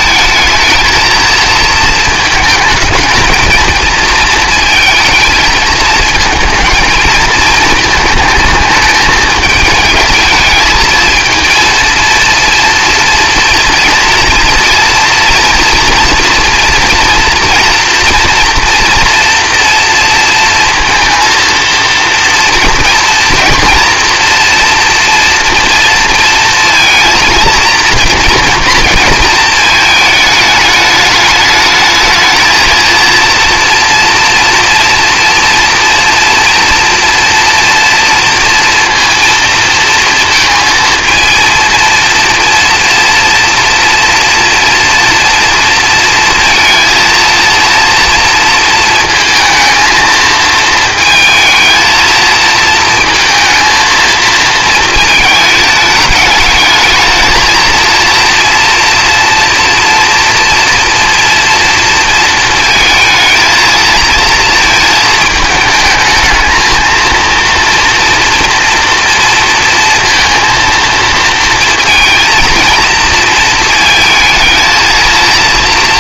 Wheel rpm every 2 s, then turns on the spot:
220, 220, 230, 220, 220, 220, 230, 230, 240, 240, 230, 230, 230, 230, 230, 220, 220, 230, 230, 230, 230, 240, 230, 230, 230, 220, 220, 230, 210, 230, 240, 230, 230, 220, 240, 230, 230, 220.
none